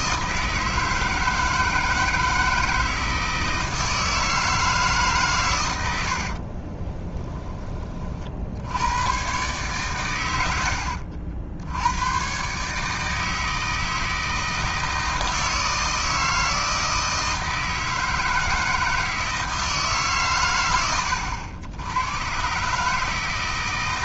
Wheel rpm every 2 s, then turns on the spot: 160, 160, 150, 20, 100, 70, 150, 160, 160, 160, 90, 150.
6-8